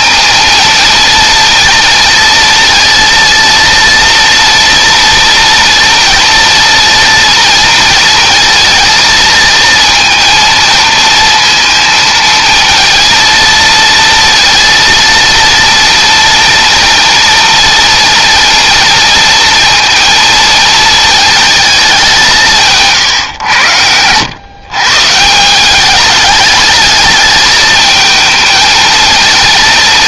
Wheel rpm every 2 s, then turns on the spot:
220, 230, 230, 230, 230, 230, 220, 230, 230, 230, 220, 180, 130, 210, 220.
none